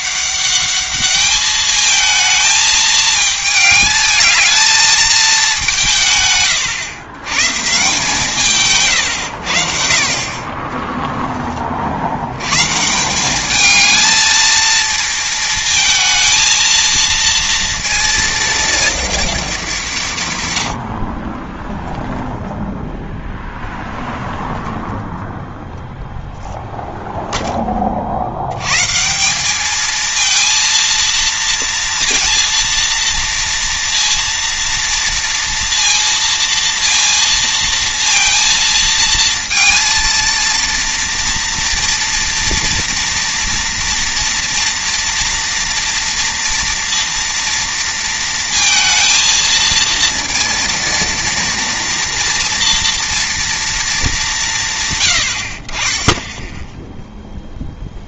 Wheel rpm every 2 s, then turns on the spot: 200, 220, 220, 120, 140, 30, 120, 230, 220, 230, 90, 0, 0, 0, 110, 230, 230, 230, 230, 230, 230, 230, 230, 230, 220, 230, 240, 150, 0.
none